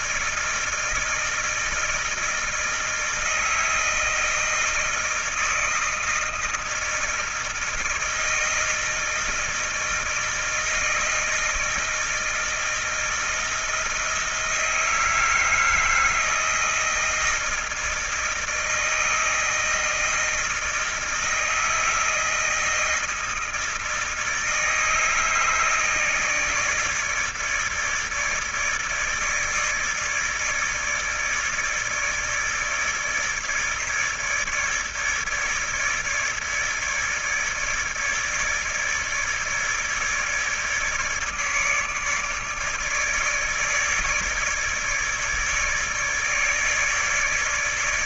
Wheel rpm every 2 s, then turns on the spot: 160, 160, 160, 160, 160, 160, 160, 160, 160, 160, 160, 160, 160, 160, 150, 160, 150, 150, 150, 150, 150, 150, 150, 150.
none